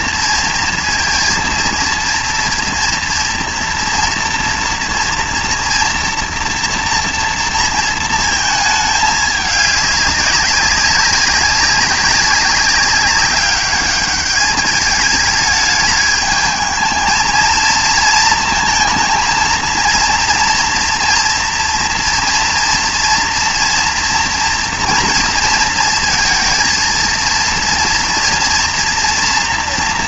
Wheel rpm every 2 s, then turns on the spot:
230, 240, 230, 230, 220, 200, 190, 210, 220, 220, 230, 230, 230, 230, 230.
none